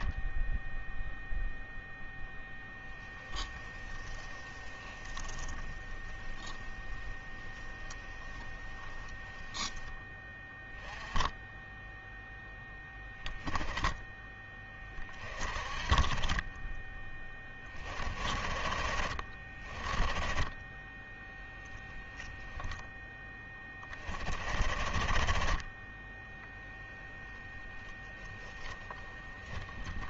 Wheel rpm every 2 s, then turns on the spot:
0, 0, 10, 10, 10, 10, 0, 10, 20, 30, 20, 10, 40, 10, 10.
4-10 22-24 26-30